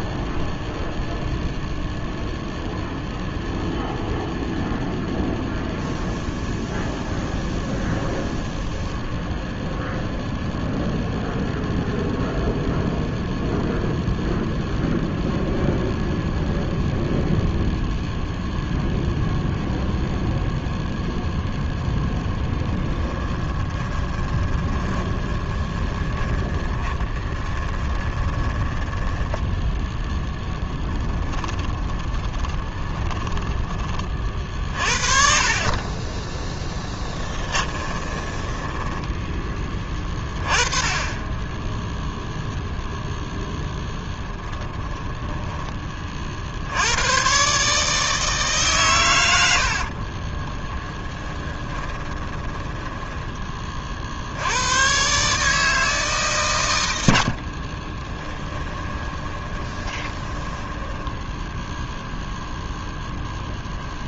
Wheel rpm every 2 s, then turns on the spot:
0, 0, 0, 0, 0, 0, 0, 0, 0, 0, 0, 20, 20, 20, 10, 10, 20, 40, 10, 10, 20, 0, 10, 90, 130, 20, 10, 110, 90, 20, 10, 0.
22-28 30-34 36-40 44-46 50-54 58-62